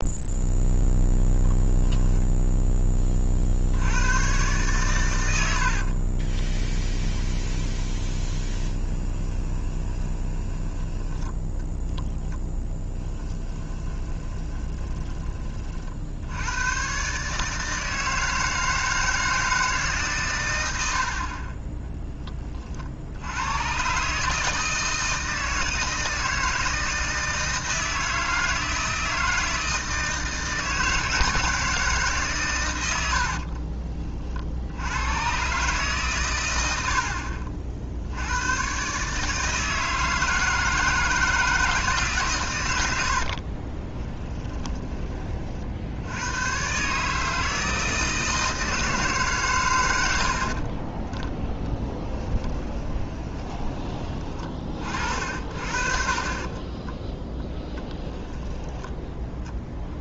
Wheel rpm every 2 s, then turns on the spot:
0, 20, 120, 20, 20, 10, 20, 20, 120, 160, 80, 60, 160, 160, 160, 160, 90, 80, 80, 130, 160, 90, 20, 140, 160, 30, 20, 40, 20, 10.
6-10 12-16 44-46 50-54 56-58